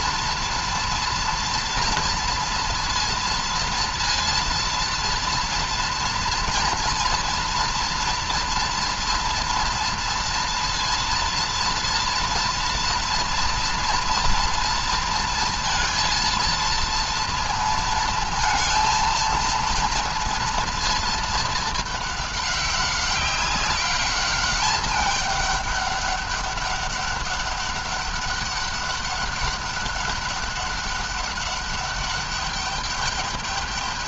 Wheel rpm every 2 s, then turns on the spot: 230, 230, 230, 230, 230, 230, 230, 230, 230, 220, 230, 200, 200, 200, 200, 200, 200.
none